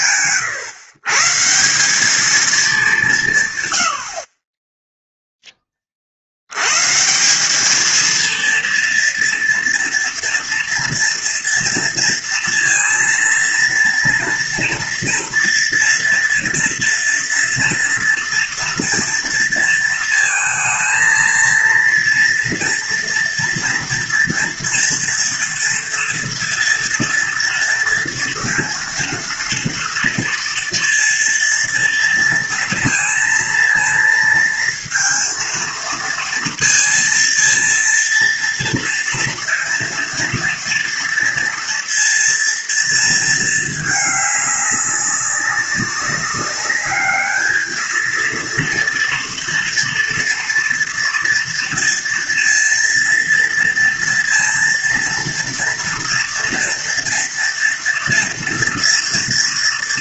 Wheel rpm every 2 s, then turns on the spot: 120, 190, 0, 140, 230, 230, 230, 230, 240, 230, 230, 230, 230, 240, 230, 230, 230, 230, 230, 230, 230, 230, 200, 200, 230, 240, 230, 230, 230, 230.
none